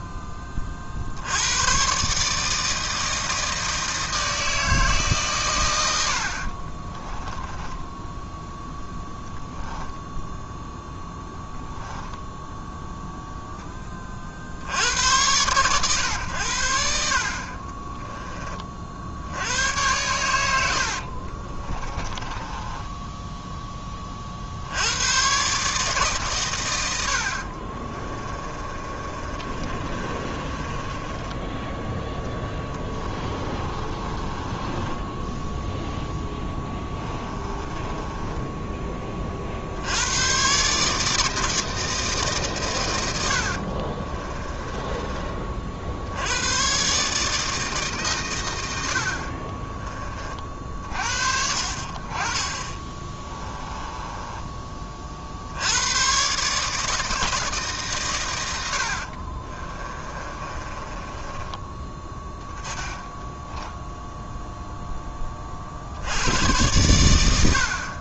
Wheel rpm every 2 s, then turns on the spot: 50, 160, 160, 30, 10, 0, 0, 50, 80, 40, 70, 20, 90, 100, 30, 20, 20, 10, 10, 20, 140, 120, 20, 130, 70, 50, 20, 30, 150, 70, 20, 10, 0, 100.
6-8 22-24 28-34 36-38 44-46 52-54 58-64